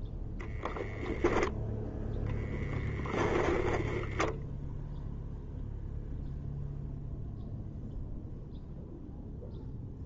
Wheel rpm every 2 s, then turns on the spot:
0, 0, 0, 0, 0.
none